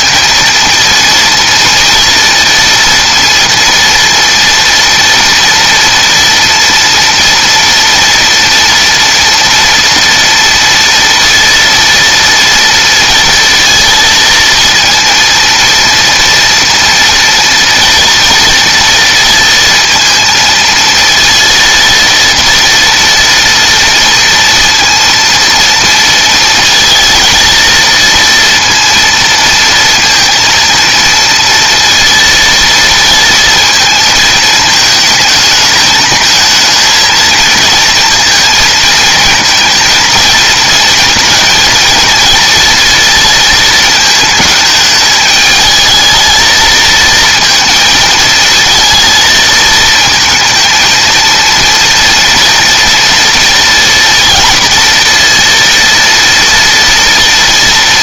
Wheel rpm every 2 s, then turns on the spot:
230, 230, 230, 240, 230, 230, 230, 230, 230, 230, 230, 230, 230, 230, 230, 230, 230, 220, 220, 230, 230, 230, 220, 220, 220, 220, 230, 230, 230.
none